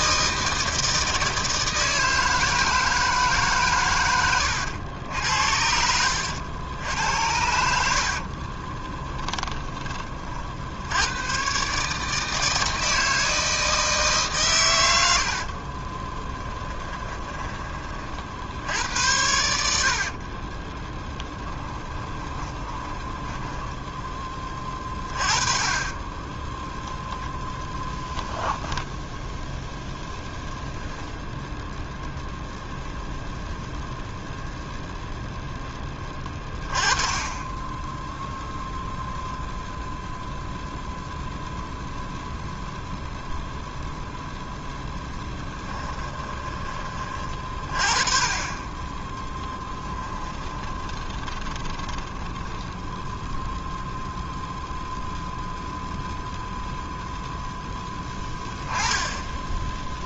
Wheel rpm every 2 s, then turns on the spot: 160, 160, 80, 80, 20, 90, 160, 80, 10, 80, 10, 10, 20, 10, 10, 0, 0, 0, 20, 0, 0, 0, 0, 30, 20, 20, 0, 0, 0, 10.
8-10 16-18 20-24 28-30 50-52